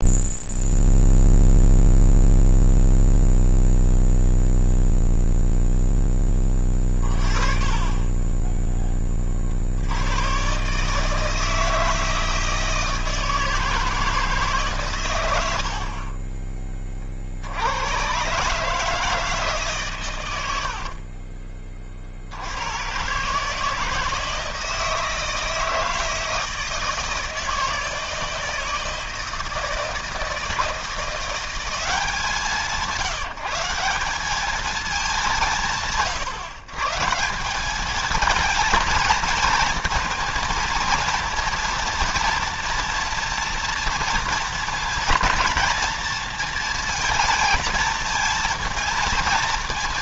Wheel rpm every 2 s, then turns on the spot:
0, 0, 0, 30, 20, 140, 160, 140, 30, 150, 80, 100, 160, 160, 160, 160, 170, 200, 130, 220, 230, 230, 230, 230, 230.
6-8 20-22